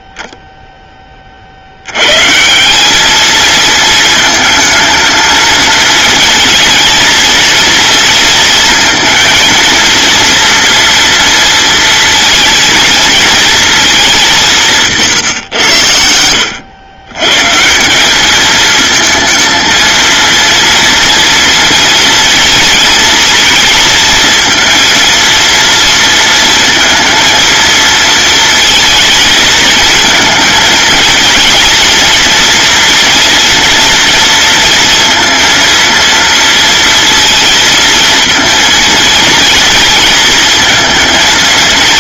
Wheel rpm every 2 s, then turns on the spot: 10, 180, 220, 230, 230, 230, 230, 170, 100, 220, 230, 230, 230, 230, 230, 220, 230, 230, 230, 230, 220.
none